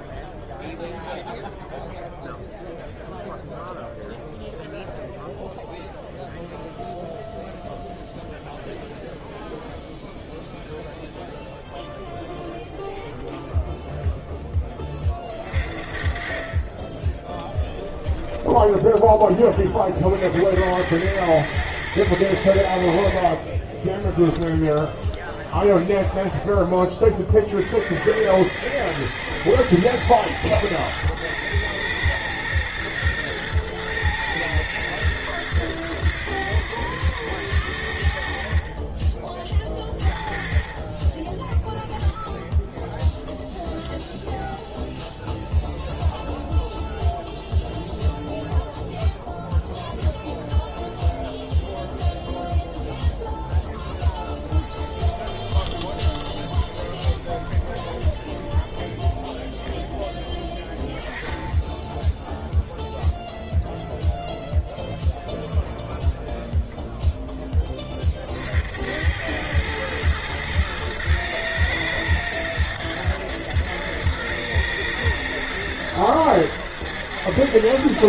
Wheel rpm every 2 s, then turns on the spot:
0, 0, 0, 0, 0, 0, 0, 10, 30, 10, 70, 90, 10, 20, 100, 110, 110, 120, 100, 40, 30, 10, 0, 0, 0, 0, 0, 10, 20, 10, 10, 0, 0, 0, 60, 110, 110, 110, 110.
18-20 24-26 54-60